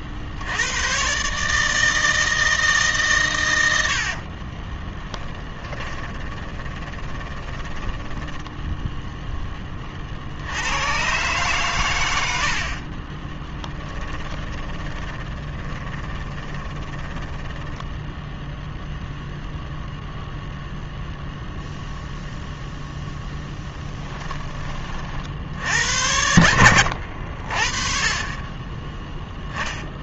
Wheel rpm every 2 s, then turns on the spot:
100, 150, 10, 20, 10, 100, 50, 20, 20, 0, 0, 0, 30, 80, 10.
4-8 12-18